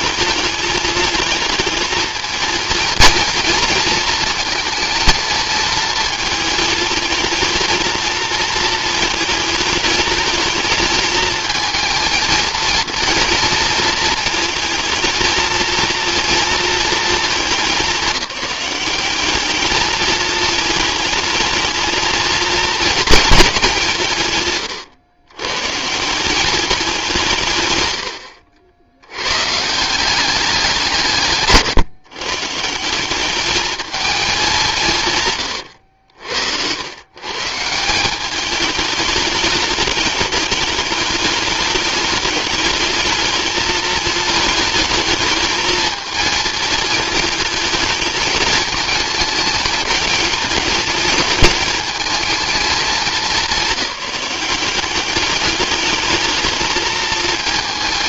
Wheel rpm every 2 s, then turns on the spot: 220, 230, 220, 220, 220, 220, 230, 230, 220, 200, 220, 220, 110, 200, 60, 160, 180, 180, 120, 210, 210, 210, 220, 220, 220, 210, 210, 200, 220.
none